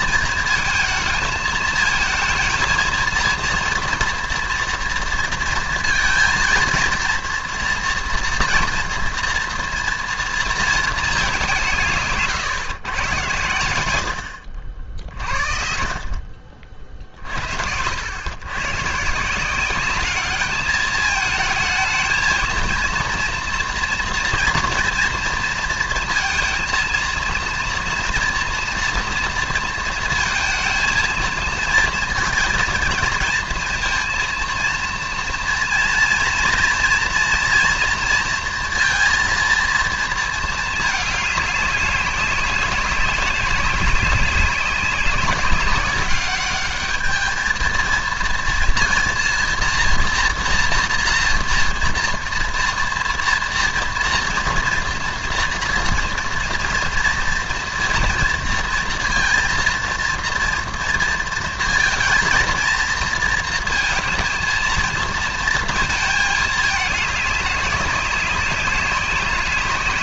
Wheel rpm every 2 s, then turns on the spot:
220, 230, 230, 230, 230, 230, 130, 70, 50, 130, 210, 230, 230, 230, 230, 230, 230, 230, 230, 230, 220, 200, 190, 210, 230, 230, 230, 230, 230, 230, 230, 230, 230, 210, 200.
none